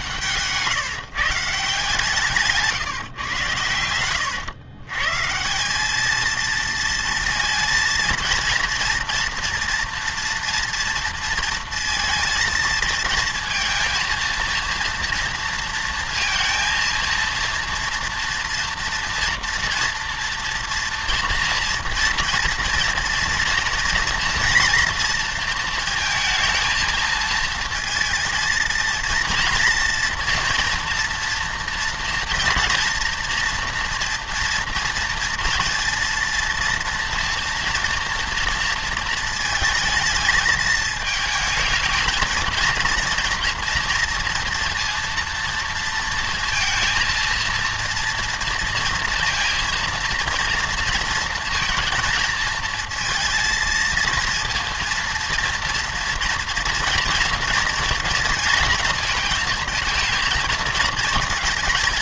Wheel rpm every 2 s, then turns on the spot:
150, 150, 130, 230, 230, 230, 230, 230, 230, 230, 240, 230, 230, 230, 230, 230, 230, 230, 230, 230, 220, 230, 230, 220, 230, 230, 230, 230, 230, 230, 230.
none